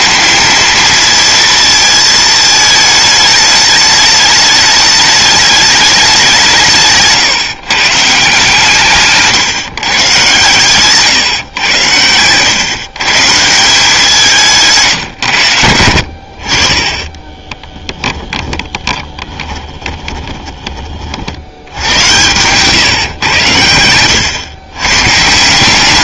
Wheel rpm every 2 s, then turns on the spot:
220, 220, 210, 160, 150, 120, 130, 160, 40, 10, 20, 120, 120.
18-20